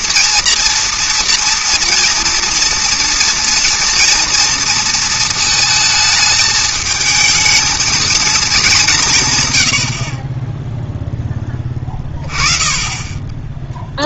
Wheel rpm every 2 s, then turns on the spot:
230, 230, 230, 220, 200, 0, 20.
none